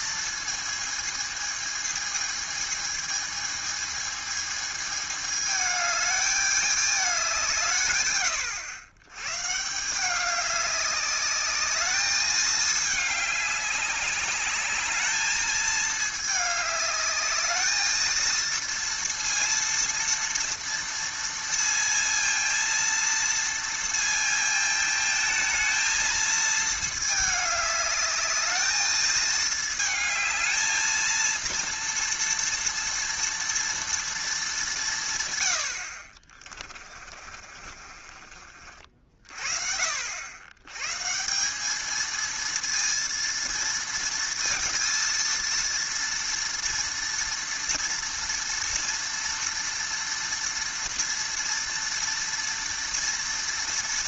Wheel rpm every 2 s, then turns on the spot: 220, 220, 210, 210, 110, 200, 210, 210, 210, 230, 230, 230, 220, 220, 210, 220, 230, 170, 30, 50, 130, 230, 230, 230, 230, 230, 230.
36-38